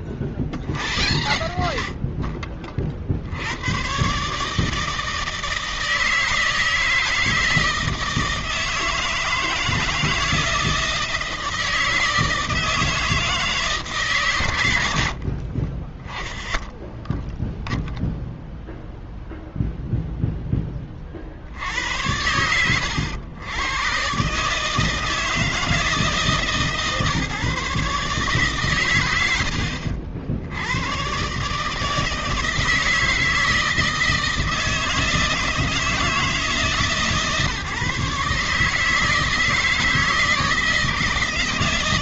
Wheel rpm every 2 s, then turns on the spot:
40, 60, 150, 160, 160, 160, 160, 110, 10, 0, 10, 80, 140, 150, 130, 80, 160, 160, 160, 150, 160.
none